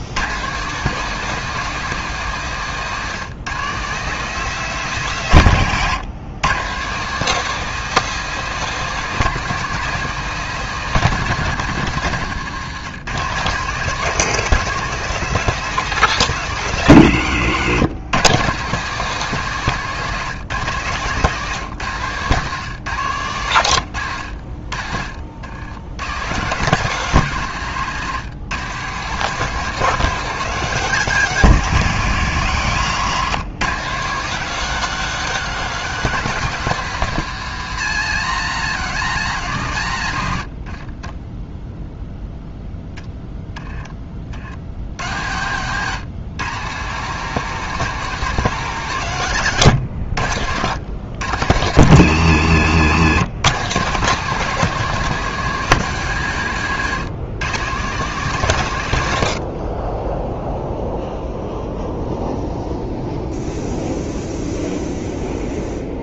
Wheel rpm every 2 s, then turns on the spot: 160, 160, 180, 150, 200, 190, 150, 200, 140, 170, 150, 140, 60, 150, 150, 180, 120, 180, 180, 150, 50, 0, 60, 150, 170, 90, 110, 180, 140, 140, 0, 0, 0.
40-42